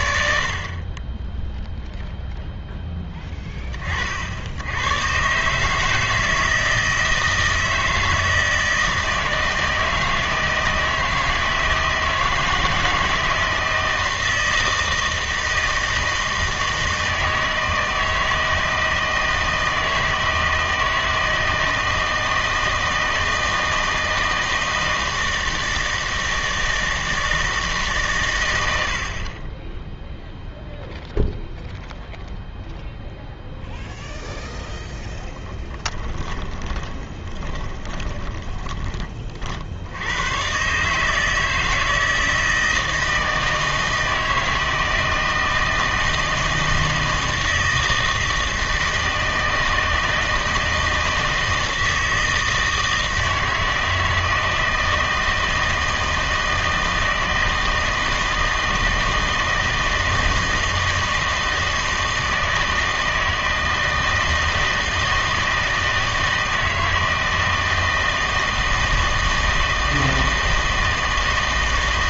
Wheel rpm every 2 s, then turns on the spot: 40, 10, 100, 160, 160, 160, 160, 160, 160, 160, 160, 160, 160, 160, 80, 0, 0, 0, 10, 20, 130, 160, 160, 160, 160, 160, 160, 160, 160, 160, 160, 160, 160, 160, 160, 160.
36-38